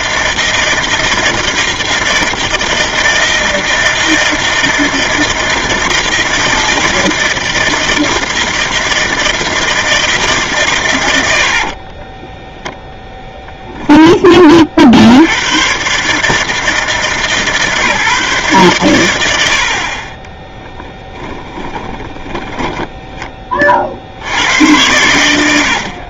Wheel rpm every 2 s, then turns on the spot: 160, 160, 160, 160, 160, 150, 10, 20, 150, 140, 20, 20, 80.
12-14 22-24